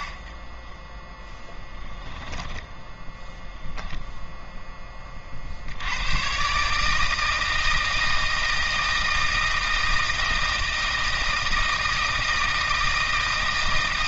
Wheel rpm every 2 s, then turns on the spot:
30, 10, 10, 140, 160, 160, 160.
2-4